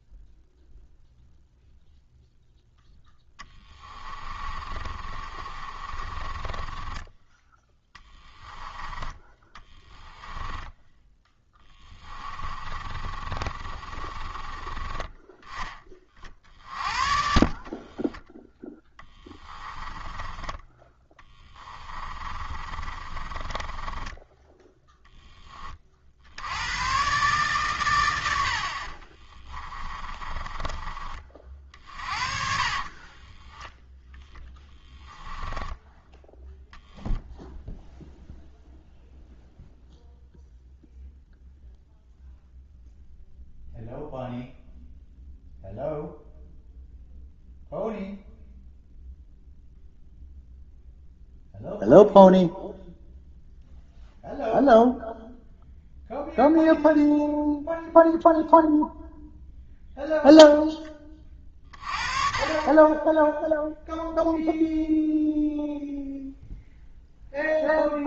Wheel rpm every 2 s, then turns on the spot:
0, 0, 30, 20, 10, 10, 30, 20, 40, 10, 10, 30, 10, 110, 50, 30, 40, 10, 0, 0, 0, 0, 0, 0, 0, 0, 0, 0, 0, 0, 10, 30, 0, 0.
4-8 10-14 16-24 28-36